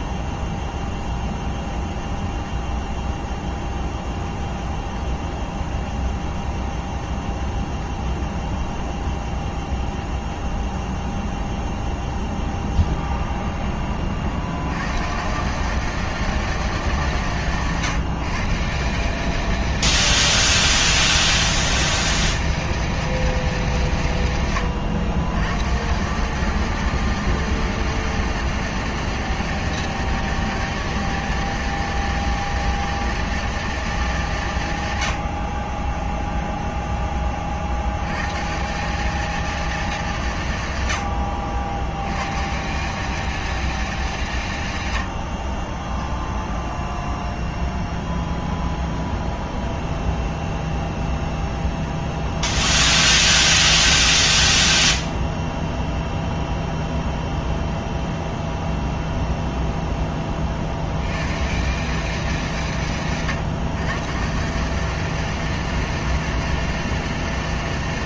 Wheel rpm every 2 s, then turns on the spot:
20, 20, 20, 20, 20, 20, 20, 90, 220, 170, 210, 210, 120, 200, 210, 220, 230, 160, 0, 170, 120, 140, 130, 0, 0, 0, 0, 0, 0, 0, 50, 160, 180, 210.
0-14 24-26